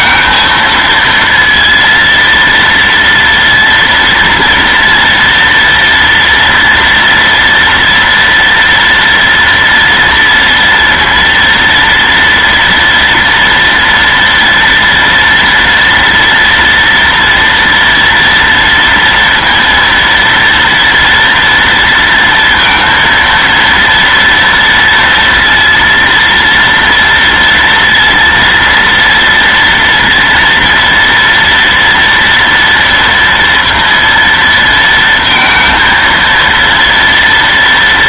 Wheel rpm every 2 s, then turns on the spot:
220, 230, 230, 240, 230, 230, 230, 230, 230, 230, 230, 230, 230, 230, 230, 230, 230, 230, 230.
none